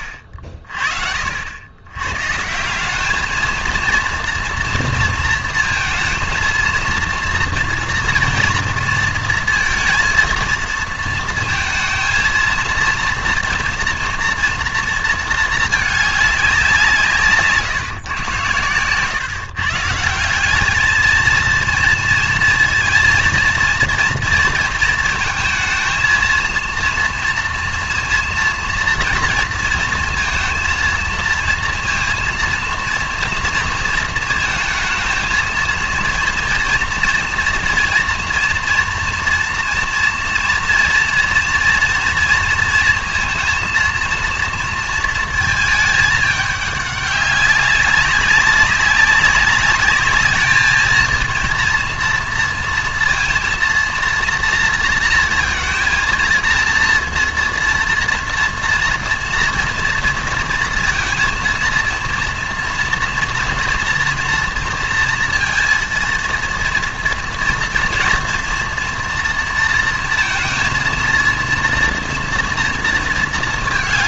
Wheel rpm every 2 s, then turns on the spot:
50, 180, 230, 230, 230, 230, 230, 230, 180, 110, 200, 230, 230, 230, 230, 230, 230, 220, 230, 230, 230, 230, 230, 200, 190, 220, 230, 230, 230, 230, 230, 230, 230, 230, 240, 230, 230.
none